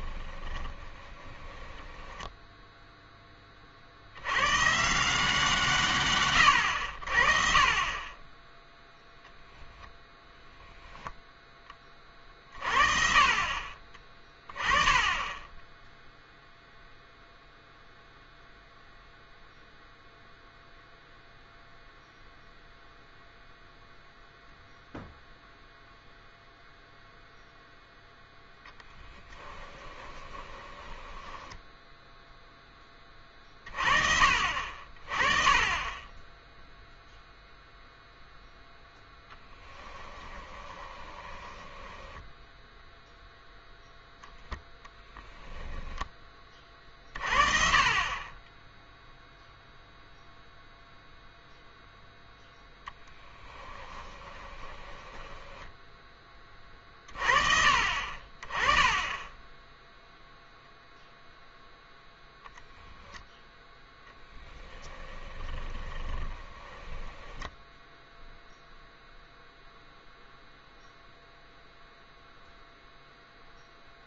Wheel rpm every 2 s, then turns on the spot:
20, 0, 130, 80, 0, 10, 40, 30, 0, 0, 0, 0, 0, 0, 10, 10, 20, 40, 0, 0, 20, 0, 0, 40, 0, 0, 10, 20, 30, 20, 0, 0, 10, 10, 0, 0, 0.
0-2 28-32 40-42 54-56 64-68